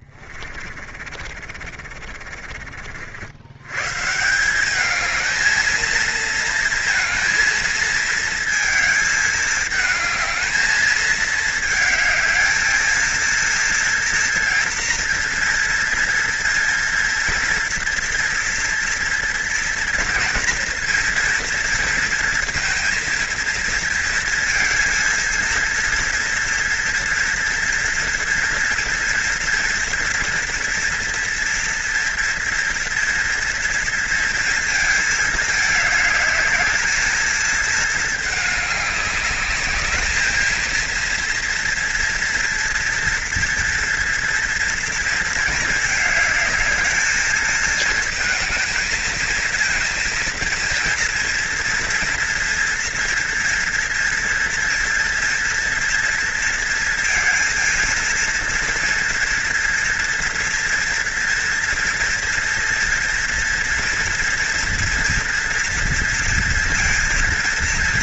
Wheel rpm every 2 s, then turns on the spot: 40, 50, 180, 230, 220, 220, 220, 230, 230, 230, 230, 230, 230, 230, 240, 230, 230, 220, 210, 210, 230, 230, 230, 210, 220, 230, 230, 230, 230, 230, 230, 230, 230, 230.
0-4